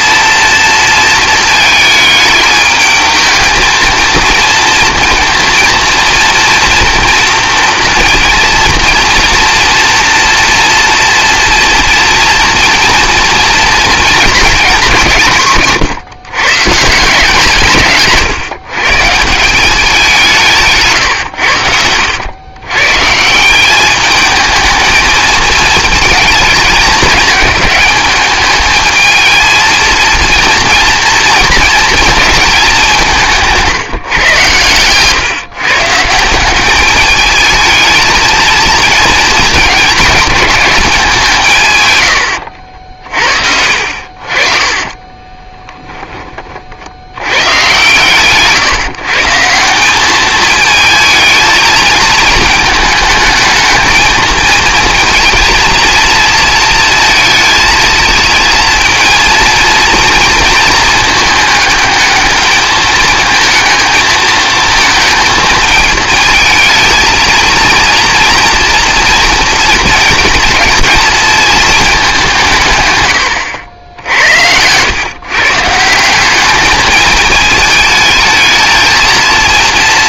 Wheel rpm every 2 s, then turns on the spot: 230, 220, 230, 230, 230, 240, 230, 180, 160, 150, 160, 140, 220, 210, 220, 230, 200, 120, 200, 230, 200, 60, 30, 60, 140, 220, 220, 230, 220, 230, 230, 210, 220, 220, 230, 230, 140, 110, 210, 230.
20-22 42-46